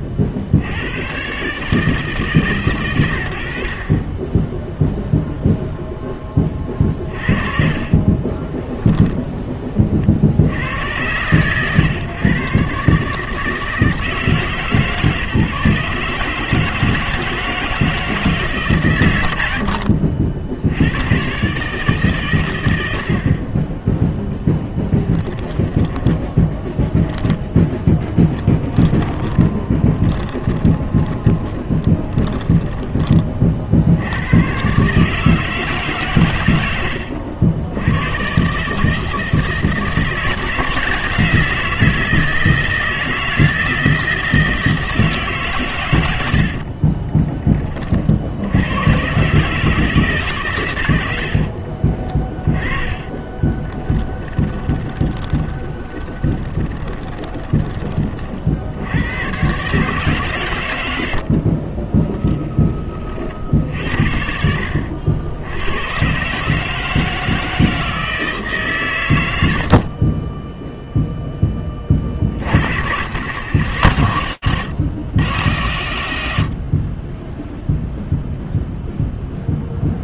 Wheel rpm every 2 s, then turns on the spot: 100, 110, 0, 30, 10, 80, 130, 150, 160, 140, 80, 100, 20, 10, 10, 20, 20, 120, 100, 150, 160, 160, 160, 40, 90, 110, 20, 20, 20, 60, 100, 10, 70, 150, 130, 0, 70, 120, 120, 0.
6-10 24-26 28-34 46-48 52-58 64-66